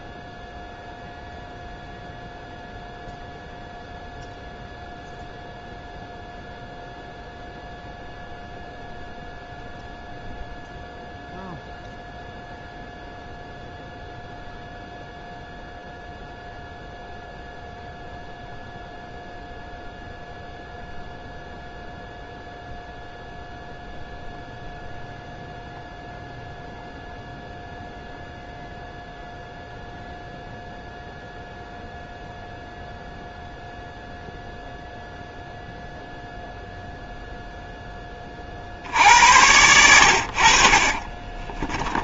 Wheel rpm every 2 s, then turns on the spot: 0, 0, 0, 0, 0, 0, 0, 0, 0, 0, 0, 0, 0, 0, 0, 0, 0, 0, 0, 60, 60.
40-42